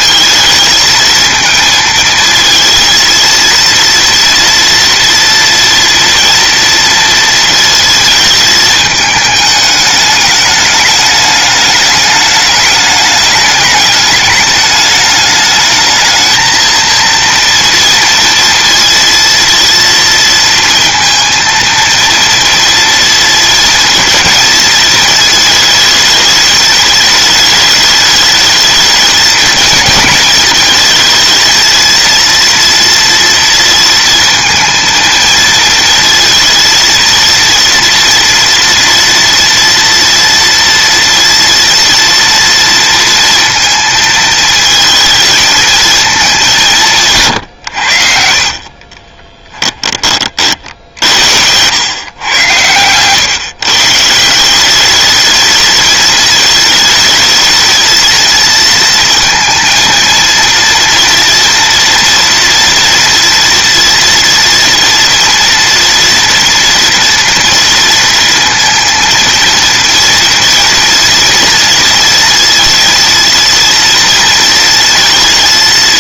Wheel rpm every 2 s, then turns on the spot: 220, 230, 230, 230, 220, 210, 210, 210, 230, 230, 230, 230, 220, 210, 220, 220, 230, 230, 230, 240, 230, 230, 220, 180, 40, 60, 120, 200, 220, 230, 230, 230, 230, 240, 230, 230, 230, 230.
48-52